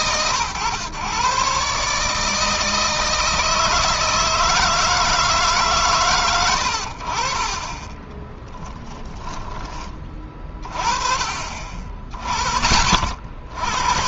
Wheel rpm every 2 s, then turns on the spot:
130, 160, 160, 70, 10, 30, 50.
none